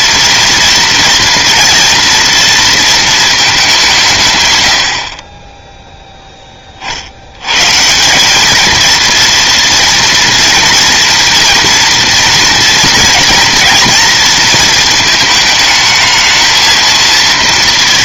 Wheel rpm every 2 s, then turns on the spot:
230, 230, 80, 20, 220, 230, 230, 230, 220.
none